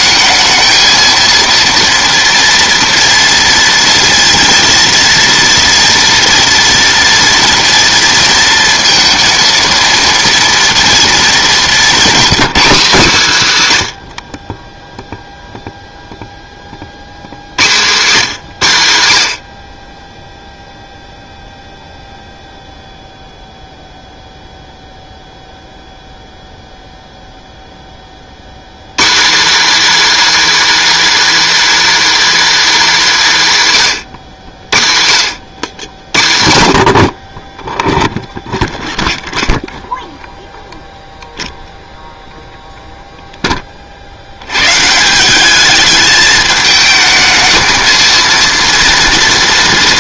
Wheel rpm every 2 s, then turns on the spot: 220, 230, 230, 230, 230, 230, 240, 20, 40, 140, 0, 0, 0, 0, 120, 350, 340, 90, 60, 0, 0, 0, 120, 220, 230.
none